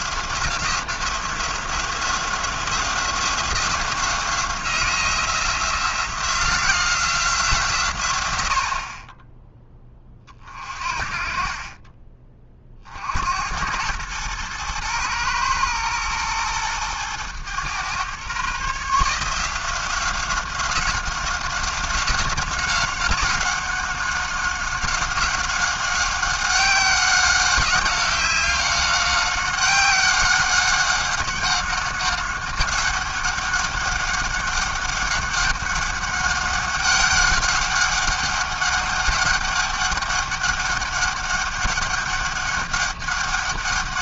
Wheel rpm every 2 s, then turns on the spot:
180, 180, 180, 170, 50, 40, 50, 120, 110, 150, 180, 190, 190, 190, 190, 190, 200, 200, 200, 200, 200, 200.
none